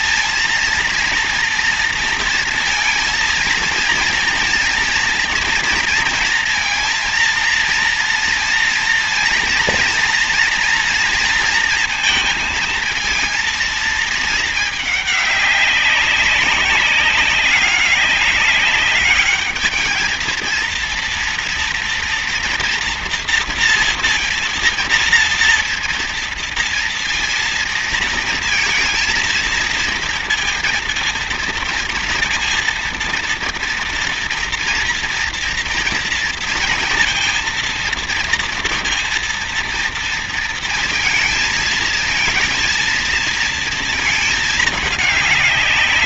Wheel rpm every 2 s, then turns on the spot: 230, 230, 230, 230, 230, 230, 220, 210, 190, 200, 230, 230, 230, 230, 220, 230, 230, 230, 230, 230, 230, 230, 210.
none